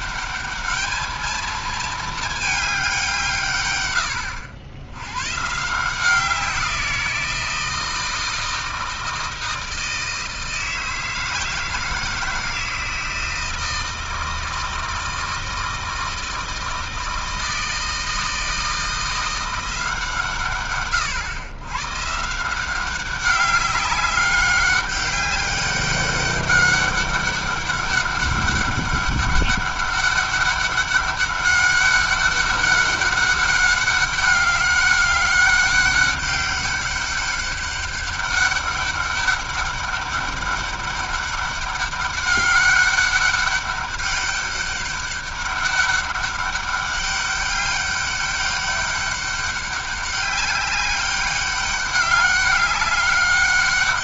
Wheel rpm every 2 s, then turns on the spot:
210, 210, 80, 180, 160, 160, 160, 160, 160, 160, 130, 170, 200, 200, 200, 200, 200, 200, 200, 200, 200, 200, 200, 200, 200, 200, 200.
none